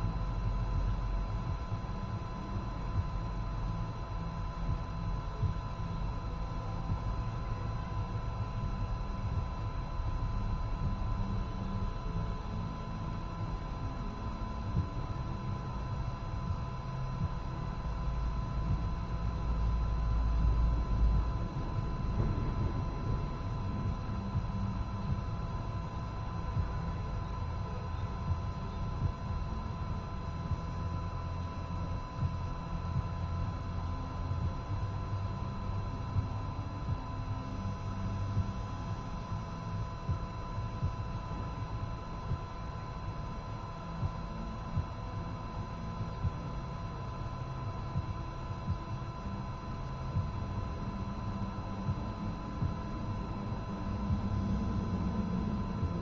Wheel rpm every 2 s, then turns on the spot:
0, 0, 0, 0, 0, 0, 0, 0, 0, 0, 0, 0, 0, 0, 0, 0, 0, 0, 0, 0, 0, 0, 0, 0, 0, 0, 0, 0.
none